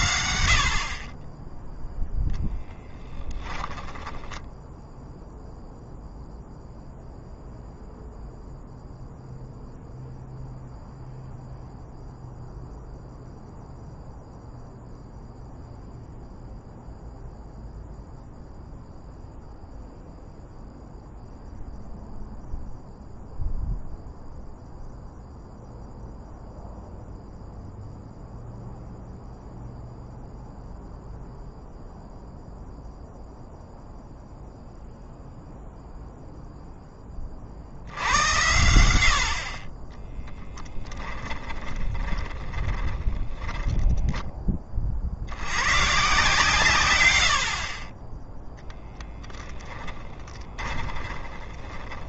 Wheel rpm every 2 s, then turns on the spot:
40, 10, 0, 0, 0, 0, 0, 0, 0, 0, 0, 0, 0, 0, 0, 0, 0, 0, 10, 80, 10, 20, 30, 120, 10, 30.
2-4 40-44 48-52